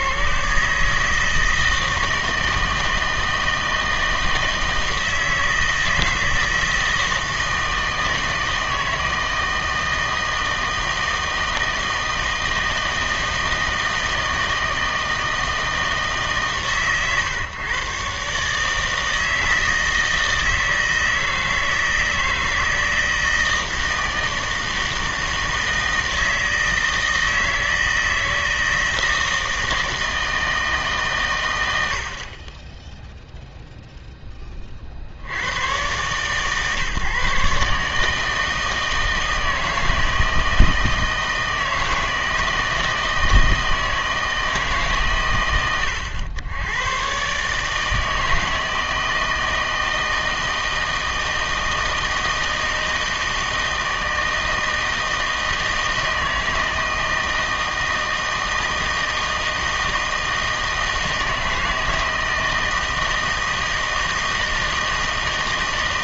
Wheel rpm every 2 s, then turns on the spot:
140, 160, 160, 160, 160, 160, 160, 160, 130, 150, 160, 160, 160, 160, 160, 160, 20, 30, 140, 160, 160, 160, 150, 100, 160, 160, 160, 160, 160, 160, 160, 160, 160.
none